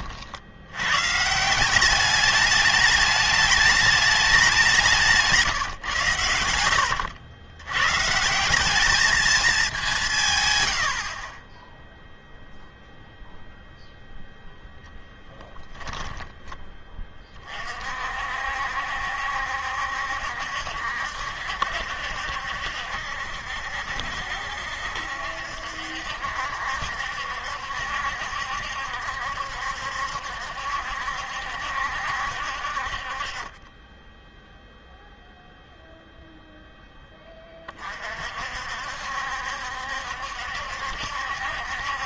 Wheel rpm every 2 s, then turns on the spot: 90, 210, 180, 80, 200, 100, 0, 0, 10, 60, 70, 70, 70, 70, 70, 70, 60, 0, 0, 60, 70.
6-8